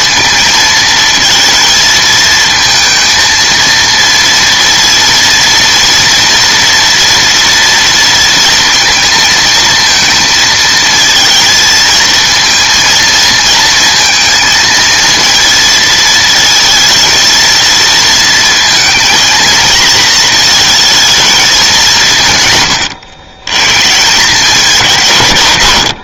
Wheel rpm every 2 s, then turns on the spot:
220, 230, 230, 230, 230, 230, 230, 230, 230, 230, 220, 120, 180.
none